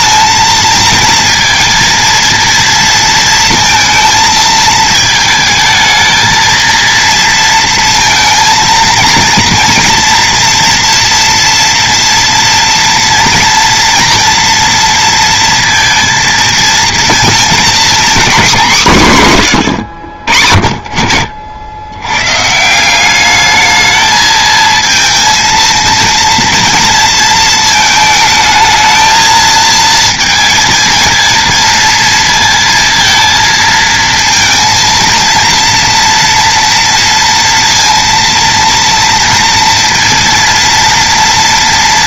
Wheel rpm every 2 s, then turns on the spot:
230, 230, 220, 230, 230, 240, 240, 230, 230, 220, 40, 160, 230, 230, 220, 230, 230, 230, 230, 230, 230.
none